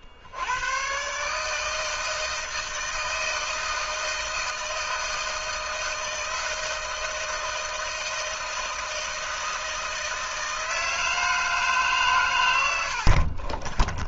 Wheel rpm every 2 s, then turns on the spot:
80, 160, 160, 160, 160, 160, 120.
none